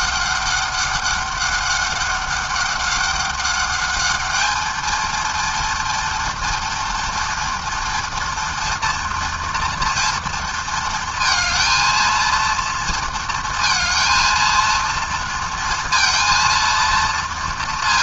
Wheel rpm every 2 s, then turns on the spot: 200, 200, 220, 230, 230, 230, 230, 230, 230.
none